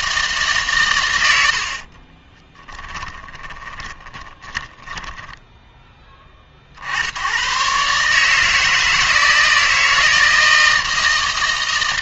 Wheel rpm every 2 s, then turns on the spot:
130, 20, 10, 70, 160, 160.
2-6